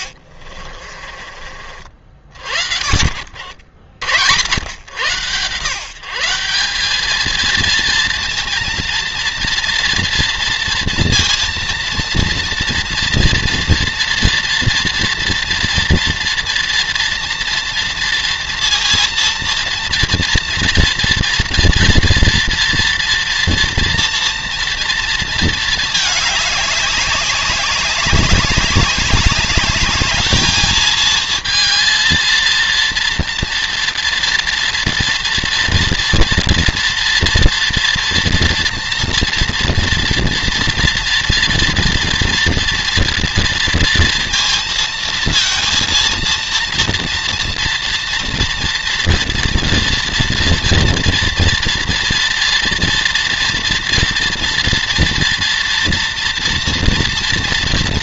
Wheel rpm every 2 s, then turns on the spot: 60, 50, 100, 200, 230, 230, 230, 230, 230, 230, 240, 230, 230, 200, 200, 220, 230, 230, 230, 230, 230, 230, 230, 230, 230, 230, 230, 230, 230.
0-4